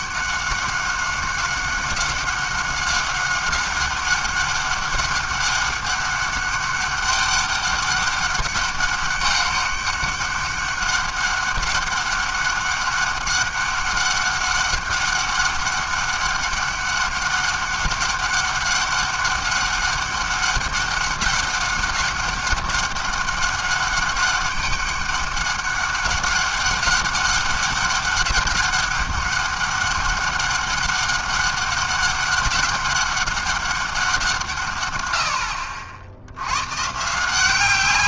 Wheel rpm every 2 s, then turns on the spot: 190, 190, 200, 200, 200, 200, 200, 200, 200, 200, 200, 200, 200, 200, 200, 200, 200, 160, 100.
none